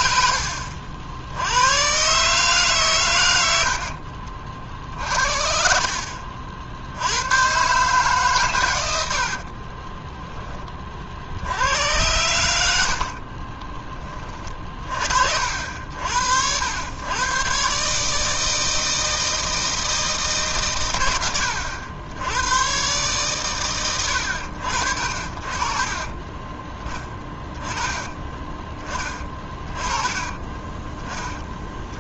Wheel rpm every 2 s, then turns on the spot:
70, 130, 60, 80, 100, 40, 60, 40, 110, 160, 120, 120, 60, 10, 20, 20.
8-10 12-14